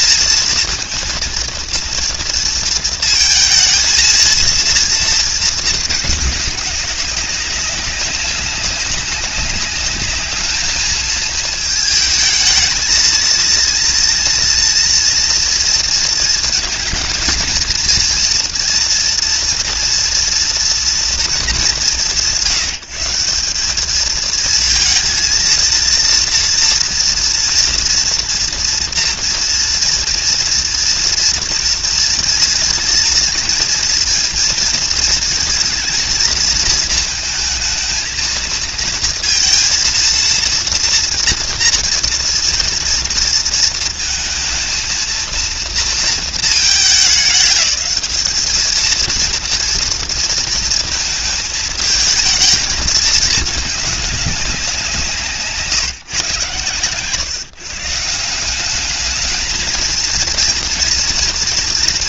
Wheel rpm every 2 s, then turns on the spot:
230, 230, 230, 210, 200, 210, 220, 230, 230, 240, 240, 170, 220, 230, 230, 230, 230, 230, 230, 230, 230, 230, 230, 220, 220, 220, 220, 190, 140, 190, 230.
none